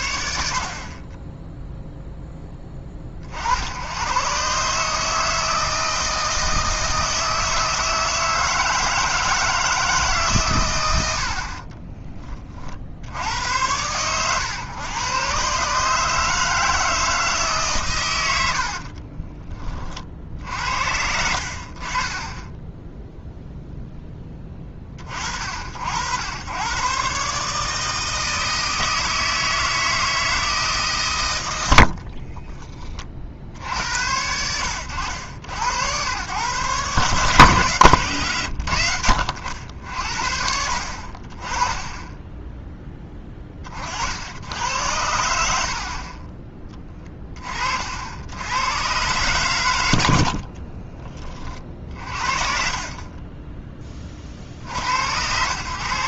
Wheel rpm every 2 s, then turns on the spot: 40, 20, 150, 160, 160, 110, 20, 120, 160, 50, 60, 10, 30, 120, 160, 140, 30, 80, 130, 80, 50, 10, 90, 20, 120, 40, 40, 70.
18-20 50-52